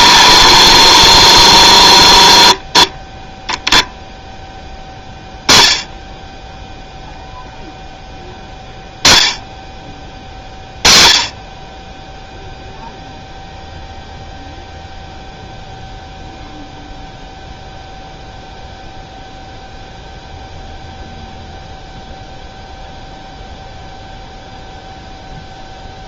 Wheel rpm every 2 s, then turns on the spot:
60, 20, 10, 0, 0, 40, 0, 0, 0, 0, 0, 0, 0.
0-4